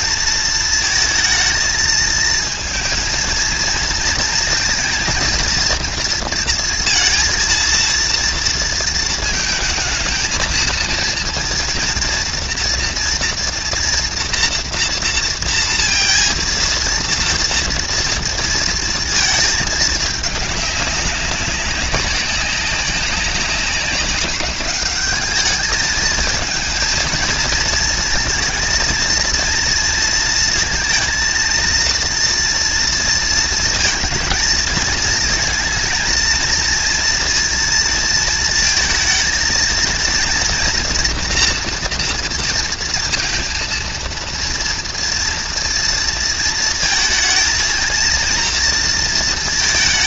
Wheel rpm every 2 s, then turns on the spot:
230, 220, 230, 230, 230, 220, 240, 230, 230, 230, 210, 190, 190, 210, 230, 230, 230, 230, 230, 230, 230, 230, 230, 230, 230.
none